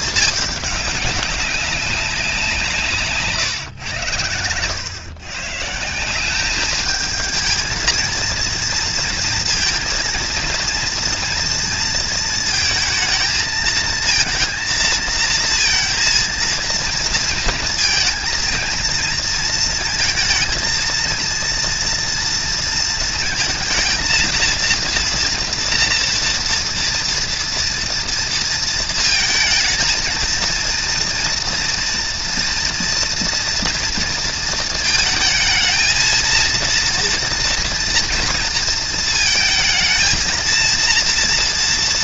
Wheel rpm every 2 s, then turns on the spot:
210, 180, 110, 190, 230, 230, 230, 230, 230, 230, 230, 230, 230, 230, 230, 230, 240, 230, 230, 230, 230.
none